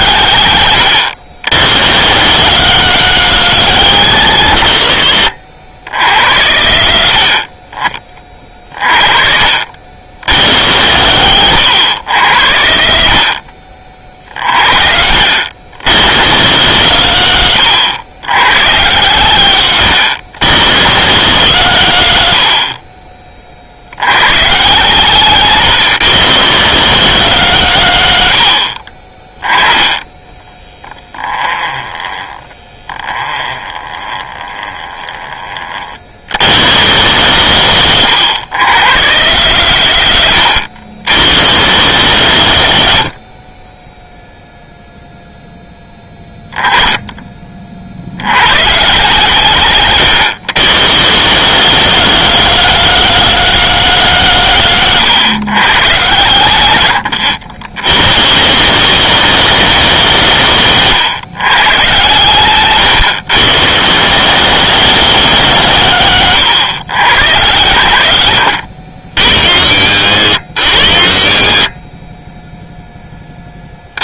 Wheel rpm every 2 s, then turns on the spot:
60, 100, 60, 40, 20, 60, 40, 30, 60, 70, 70, 20, 90, 80, 20, 10, 20, 10, 50, 60, 50, 50, 0, 10, 80, 80, 100, 70, 60, 80, 70, 70, 100, 60, 60, 60, 10.
none